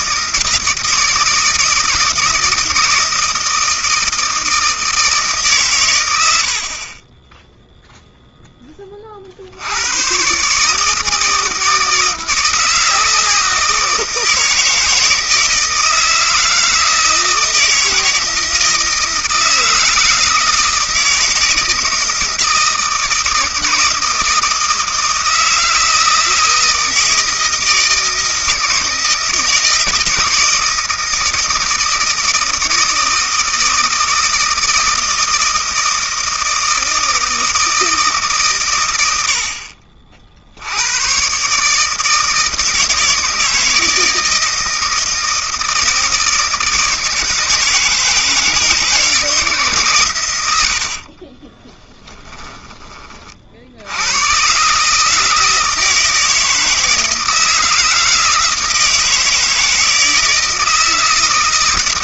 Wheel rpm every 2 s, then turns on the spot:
160, 160, 160, 60, 10, 150, 160, 160, 160, 160, 160, 160, 160, 160, 160, 160, 160, 160, 160, 120, 80, 160, 160, 160, 160, 90, 10, 130, 160, 160, 160.
50-52